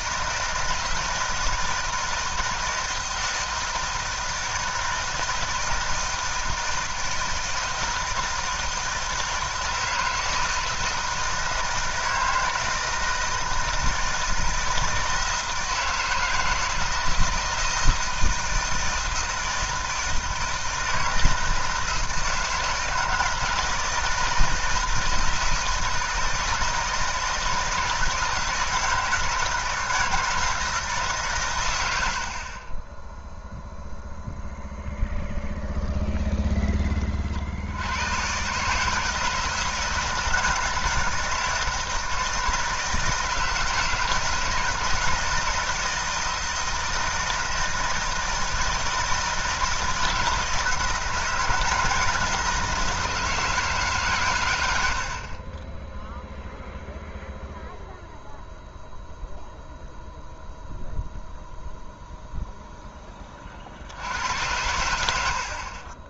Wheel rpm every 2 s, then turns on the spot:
160, 160, 160, 160, 160, 160, 160, 160, 160, 160, 160, 160, 170, 160, 160, 160, 10, 0, 20, 160, 160, 160, 160, 160, 160, 170, 170, 80, 0, 0, 0, 10, 80.
none